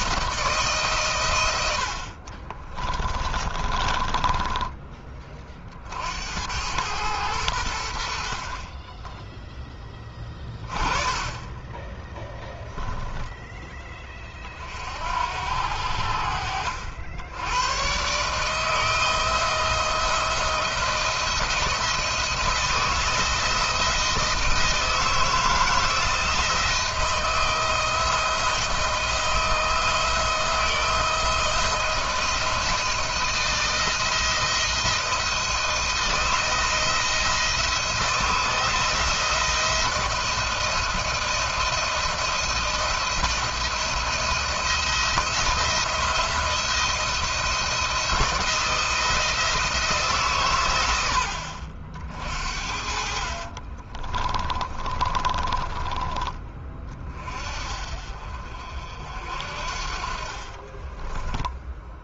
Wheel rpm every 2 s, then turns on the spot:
160, 30, 20, 100, 30, 20, 10, 50, 70, 150, 170, 170, 160, 170, 170, 170, 170, 170, 160, 160, 170, 160, 170, 170, 170, 110, 50, 30, 30, 60, 40.
2-4 12-14 52-56 60-62